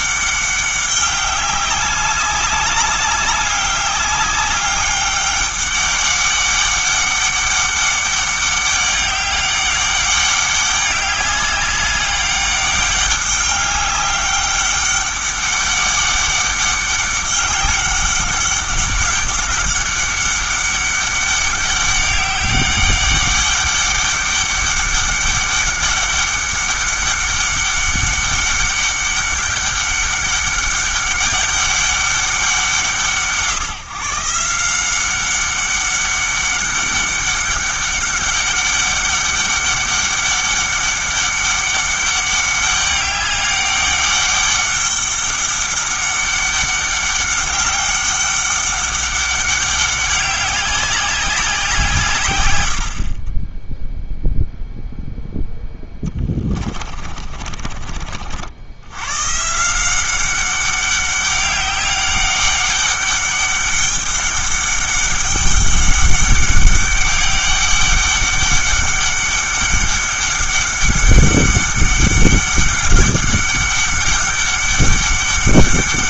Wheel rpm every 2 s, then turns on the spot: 200, 200, 200, 200, 200, 200, 200, 200, 200, 200, 200, 200, 200, 200, 200, 200, 180, 170, 200, 200, 200, 200, 200, 200, 200, 190, 100, 0, 30, 80, 190, 200, 200, 200, 200, 200, 200, 200.
56-58